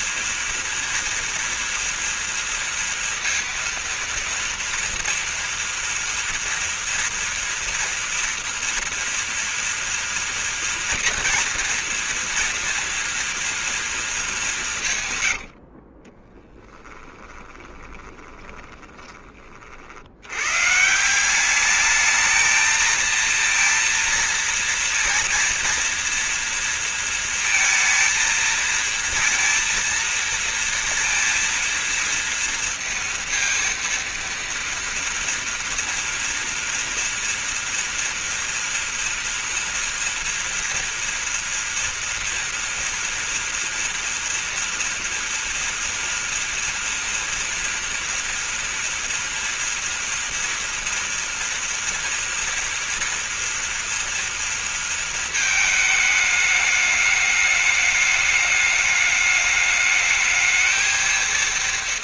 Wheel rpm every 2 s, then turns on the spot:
230, 230, 230, 230, 230, 230, 230, 180, 10, 20, 150, 230, 230, 230, 230, 230, 230, 230, 230, 230, 230, 230, 230, 230, 230, 230, 230, 230, 210, 210, 220.
16-20